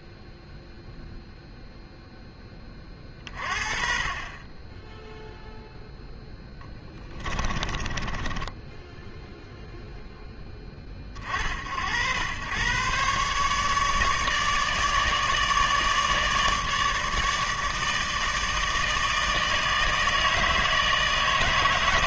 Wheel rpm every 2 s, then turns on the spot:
0, 30, 0, 20, 10, 100, 150, 150, 160, 160, 160.
6-8